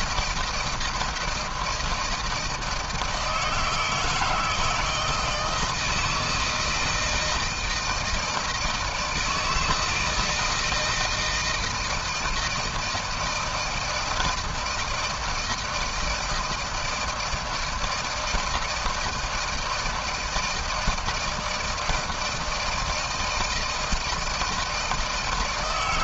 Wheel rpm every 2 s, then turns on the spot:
160, 160, 160, 160, 160, 160, 160, 160, 160, 160, 160, 160, 160.
none